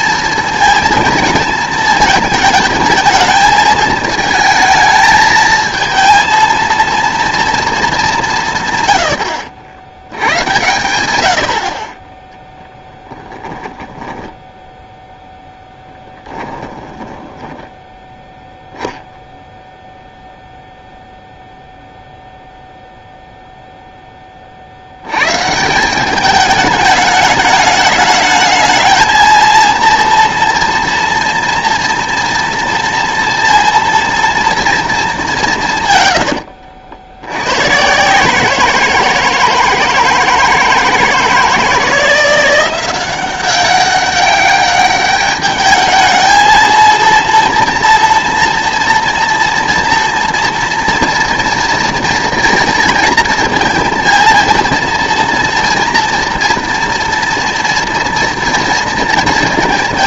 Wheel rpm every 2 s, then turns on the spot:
230, 220, 220, 230, 140, 100, 10, 10, 10, 0, 0, 0, 40, 210, 220, 230, 230, 230, 80, 160, 160, 180, 200, 220, 230, 230, 230, 230, 230, 230.
12-18 36-38